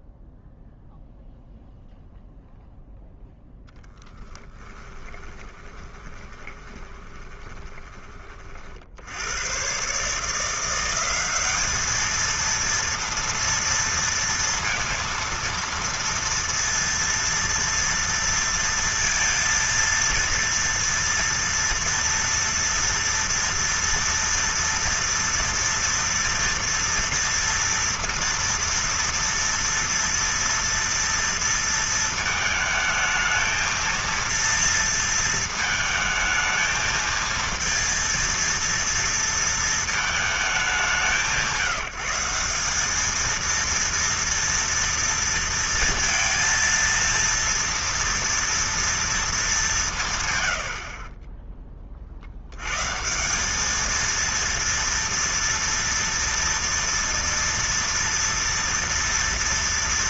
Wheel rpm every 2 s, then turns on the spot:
0, 0, 20, 20, 50, 170, 230, 230, 230, 230, 230, 230, 230, 230, 230, 230, 220, 230, 220, 230, 190, 190, 230, 230, 230, 80, 120, 230, 230, 230.
4-8